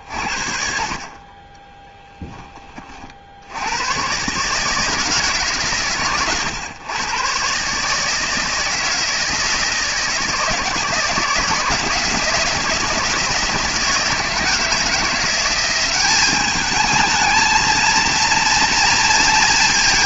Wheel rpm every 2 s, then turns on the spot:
50, 30, 150, 120, 160, 160, 170, 160, 210, 230.
none